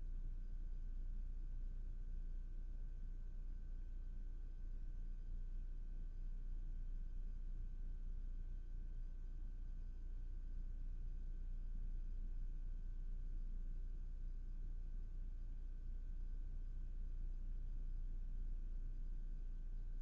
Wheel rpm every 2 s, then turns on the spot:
0, 0, 0, 0, 0, 0, 0, 0, 0, 0.
none